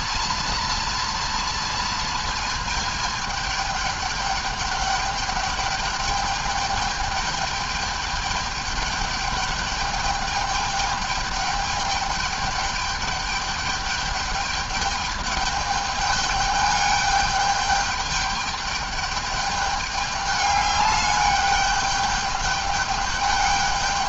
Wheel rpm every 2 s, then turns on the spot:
230, 220, 210, 210, 210, 210, 210, 210, 210, 210, 200, 210.
none